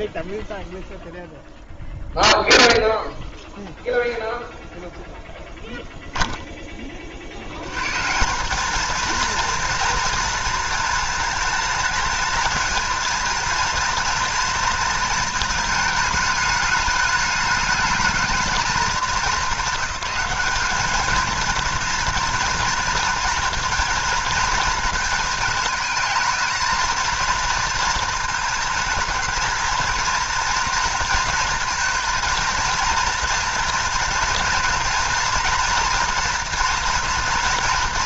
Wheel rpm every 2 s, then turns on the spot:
0, 0, 0, 20, 200, 230, 220, 230, 220, 210, 210, 230, 220, 230, 220, 230, 230, 230, 240.
none